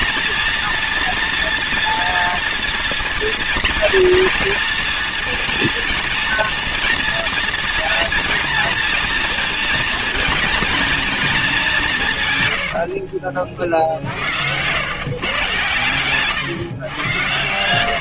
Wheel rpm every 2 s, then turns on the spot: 230, 230, 230, 230, 230, 230, 110, 100, 120.
none